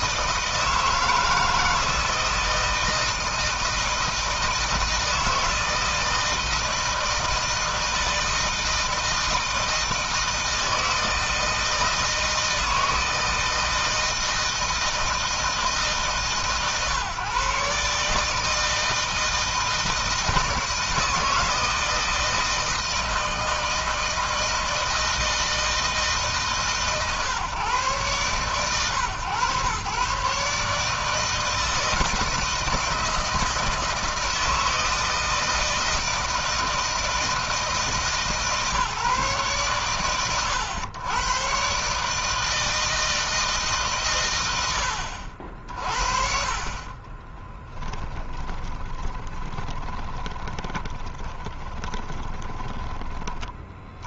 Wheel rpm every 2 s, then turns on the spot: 160, 160, 160, 160, 160, 160, 160, 160, 140, 160, 160, 160, 160, 150, 120, 150, 160, 160, 160, 150, 100, 160, 70, 40, 20, 20, 20.
46-52